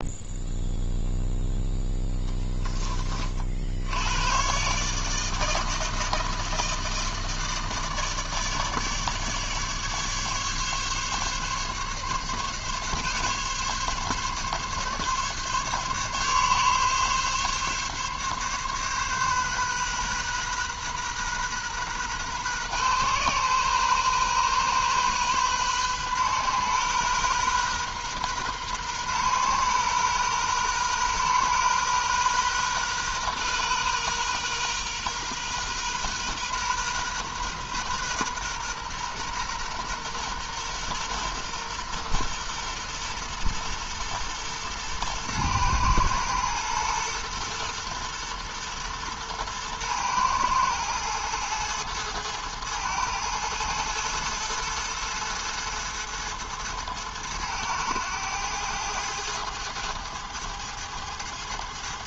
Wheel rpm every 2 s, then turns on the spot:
0, 10, 140, 160, 150, 140, 140, 140, 140, 140, 130, 130, 130, 130, 130, 120, 130, 130, 130, 120, 120, 120, 120, 120, 120, 110, 110, 110, 110, 110, 110.
none